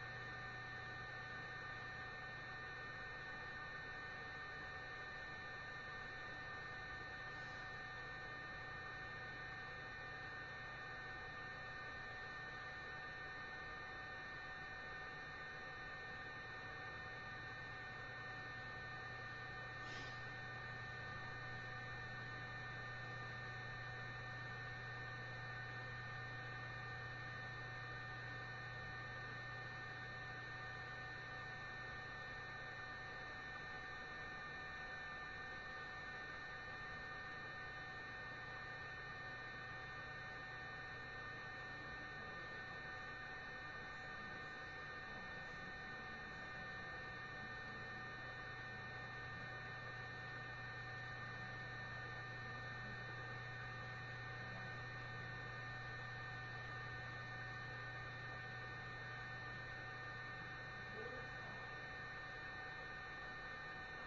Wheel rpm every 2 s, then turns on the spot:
0, 0, 0, 0, 0, 0, 0, 0, 0, 0, 0, 0, 0, 0, 0, 0, 0, 0, 0, 0, 0, 0, 0, 0, 0, 0, 0, 0, 0, 0, 0, 0.
none